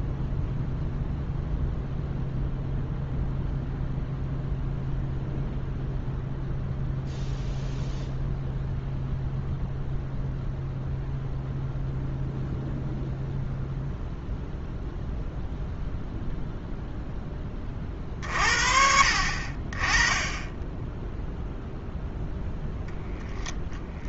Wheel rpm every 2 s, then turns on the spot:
0, 0, 0, 0, 0, 0, 0, 0, 0, 50, 0, 0.
none